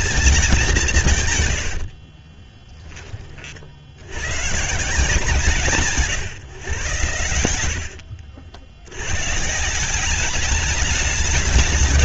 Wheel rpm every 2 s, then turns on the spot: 190, 30, 170, 110, 90, 210.
none